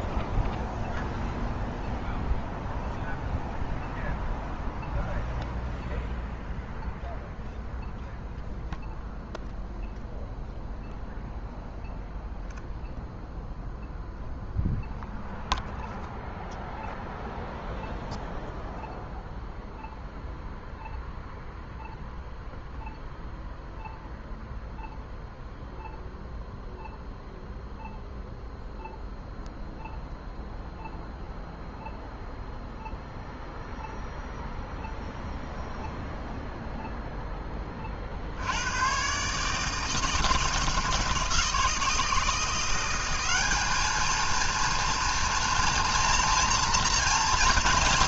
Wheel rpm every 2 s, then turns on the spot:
0, 0, 0, 0, 0, 0, 0, 0, 0, 0, 0, 0, 0, 0, 0, 0, 0, 0, 0, 90, 160, 170, 230, 230.
none